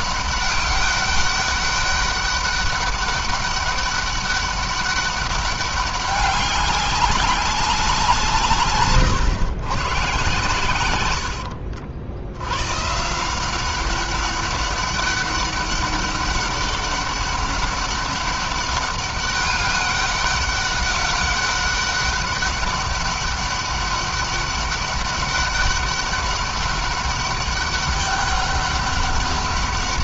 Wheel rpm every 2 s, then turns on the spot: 200, 200, 200, 190, 140, 100, 140, 200, 200, 200, 200, 200, 200, 200, 200.
none